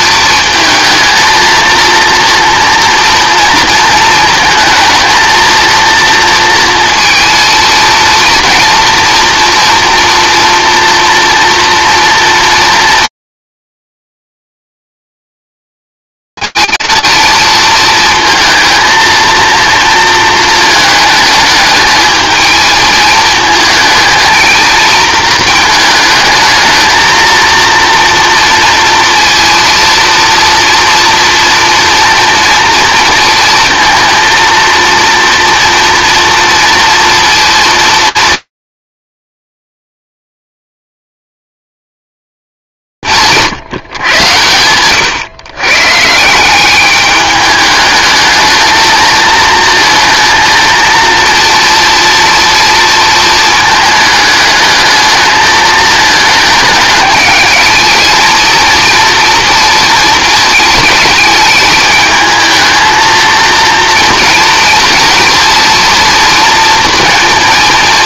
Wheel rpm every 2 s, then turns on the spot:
230, 230, 220, 230, 240, 230, 230, 220, 220, 230, 230, 220, 220, 220, 230, 230, 230, 230, 230, 230, 230, 220, 130, 150, 210, 230, 230, 220, 220, 220, 230, 220, 230, 230.
none